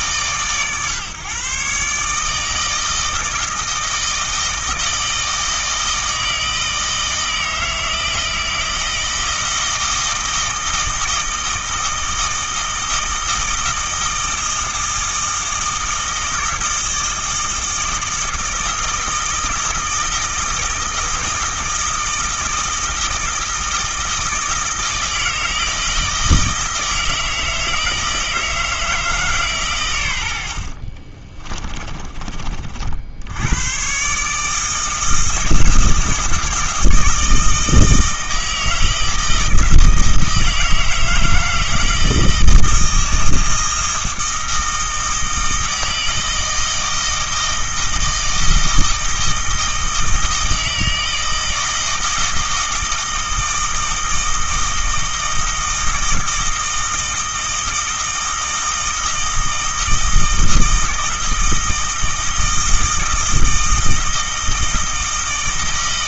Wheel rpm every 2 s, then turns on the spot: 140, 160, 160, 160, 160, 160, 160, 160, 160, 160, 160, 160, 160, 160, 160, 50, 50, 160, 160, 160, 160, 160, 160, 160, 160, 160, 160, 160, 160, 160, 160, 160, 160.
30-32